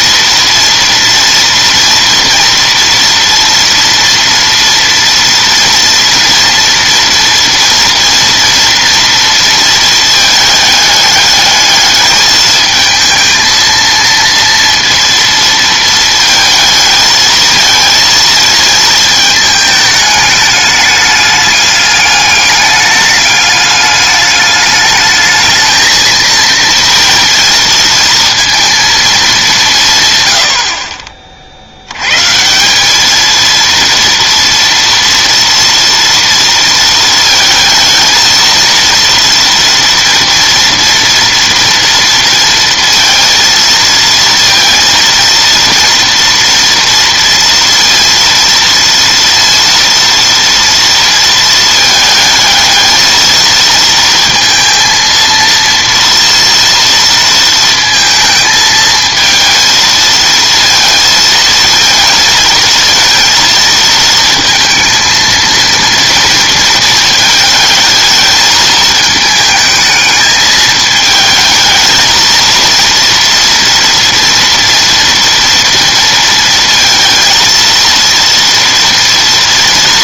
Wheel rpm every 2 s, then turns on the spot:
240, 230, 230, 240, 230, 220, 220, 230, 220, 220, 210, 210, 210, 230, 230, 60, 180, 230, 230, 230, 230, 230, 230, 230, 230, 230, 220, 230, 230, 220, 230, 230, 230, 220, 220, 210, 230, 230, 230, 230.
none